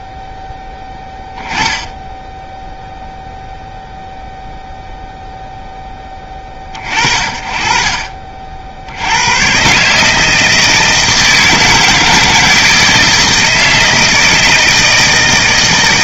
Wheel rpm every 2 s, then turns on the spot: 0, 0, 0, 50, 90, 160, 160, 160.
none